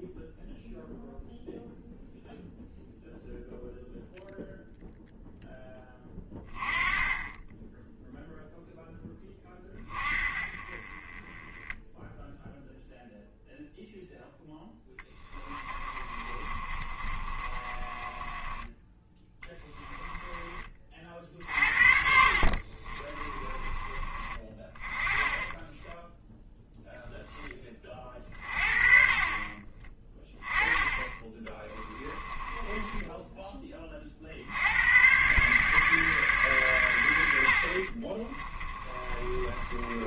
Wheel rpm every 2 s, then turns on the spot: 0, 0, 0, 10, 10, 30, 0, 20, 30, 10, 30, 40, 20, 0, 30, 20, 10, 90, 110, 30.
14-20 22-24 32-34 38-40